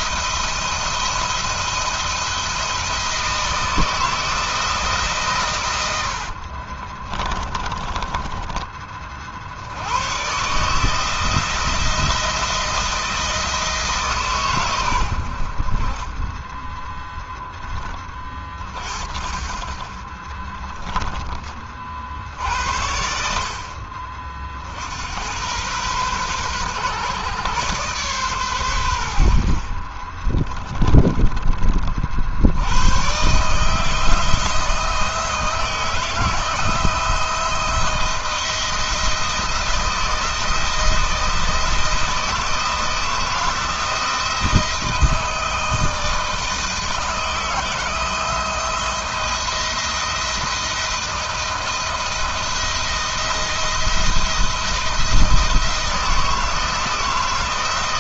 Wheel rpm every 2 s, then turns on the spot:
170, 160, 150, 20, 40, 160, 170, 90, 30, 50, 10, 70, 90, 130, 90, 20, 110, 160, 170, 170, 160, 160, 160, 160, 170, 160, 170, 170, 170.
6-8 30-32